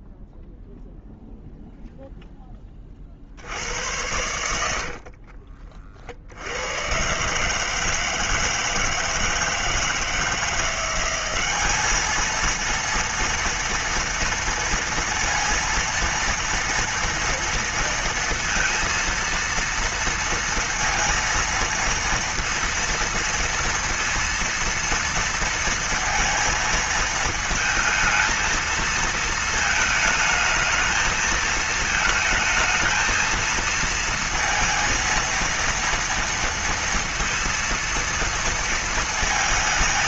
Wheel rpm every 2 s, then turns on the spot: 0, 20, 70, 90, 160, 170, 230, 230, 230, 230, 230, 230, 230, 220, 230, 220, 220, 230, 230, 230.
4-6